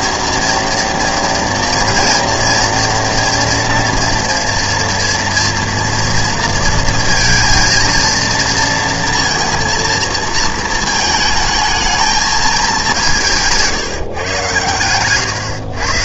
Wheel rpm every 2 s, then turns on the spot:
230, 230, 230, 230, 230, 220, 210, 130.
none